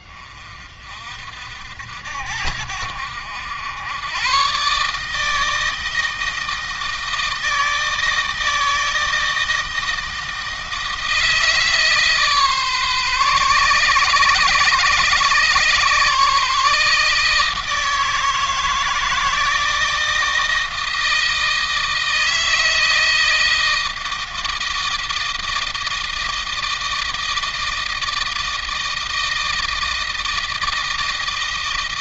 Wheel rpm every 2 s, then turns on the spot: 50, 70, 140, 160, 160, 160, 140, 130, 150, 160, 160, 160, 160, 160, 160, 160.
none